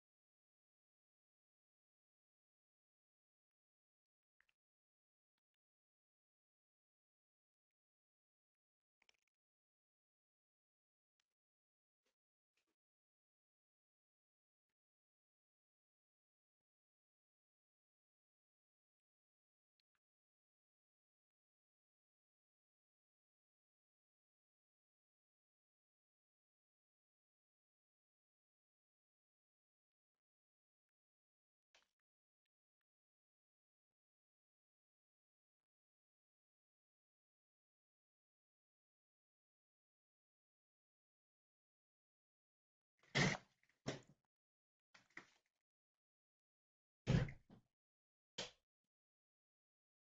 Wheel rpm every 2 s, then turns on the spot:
0, 0, 0, 0, 0, 0, 0, 0, 0, 0, 0, 0, 0, 0, 0, 0, 0, 0, 0, 0, 0, 0, 0, 0, 0.
none